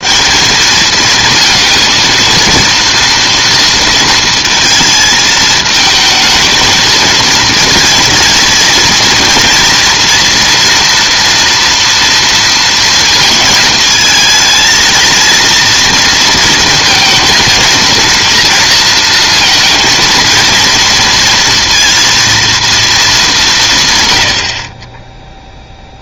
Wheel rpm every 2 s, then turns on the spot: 200, 230, 220, 220, 230, 230, 230, 230, 230, 230, 230, 230, 40.
none